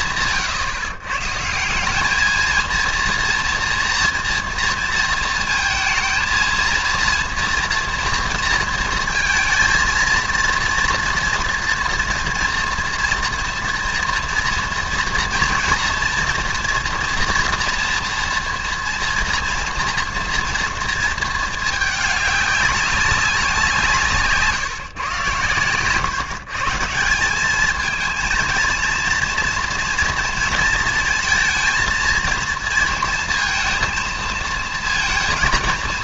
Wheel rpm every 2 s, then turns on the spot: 130, 230, 230, 230, 230, 230, 230, 230, 230, 240, 230, 200, 150, 150, 230, 230, 230, 230.
none